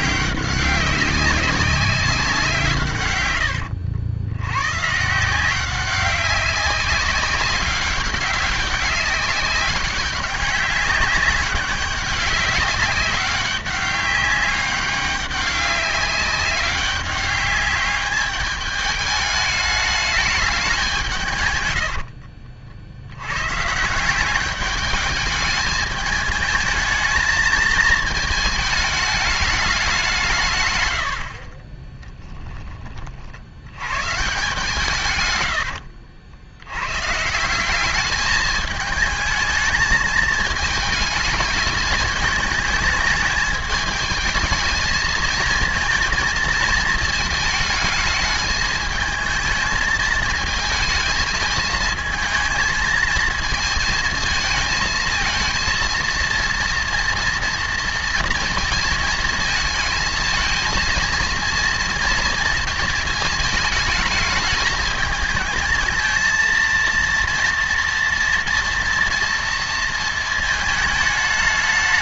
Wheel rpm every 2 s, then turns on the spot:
190, 140, 130, 190, 200, 200, 200, 200, 200, 210, 180, 70, 210, 220, 210, 110, 30, 140, 120, 220, 220, 220, 220, 220, 220, 220, 220, 220, 230, 230, 230, 220, 220, 230, 230, 220.
none